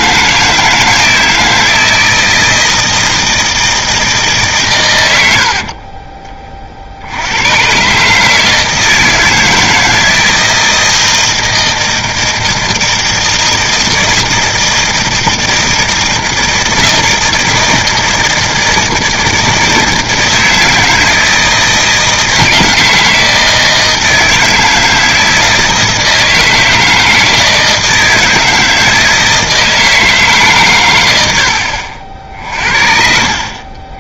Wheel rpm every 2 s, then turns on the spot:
160, 160, 100, 60, 160, 160, 160, 160, 160, 160, 160, 160, 160, 160, 160, 110, 60.
none